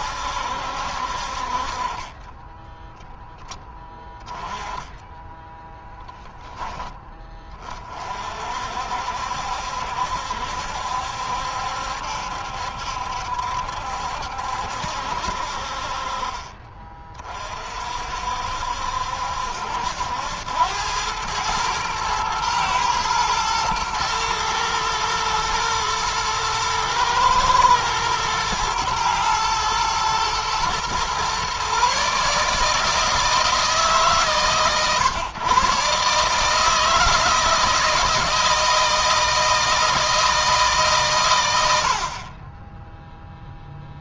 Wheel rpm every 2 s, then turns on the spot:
70, 20, 10, 10, 50, 70, 70, 70, 40, 60, 90, 110, 110, 110, 110, 110, 150, 140, 150, 160, 160, 30.
none